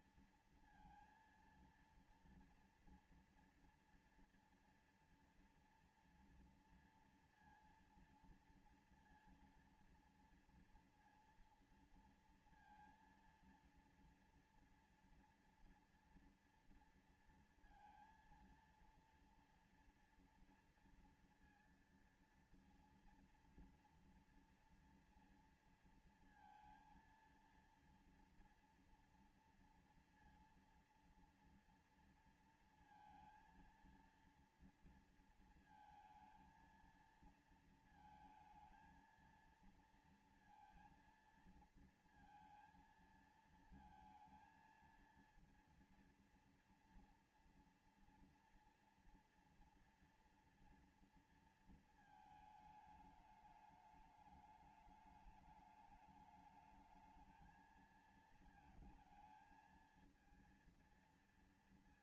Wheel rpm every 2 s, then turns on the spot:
230, 230, 230, 230, 230, 240, 230, 230, 230, 230, 230, 230, 230, 230, 230, 230, 230, 230, 230, 220, 230, 230, 220, 230, 230, 240, 230, 210, 210, 220, 220.
none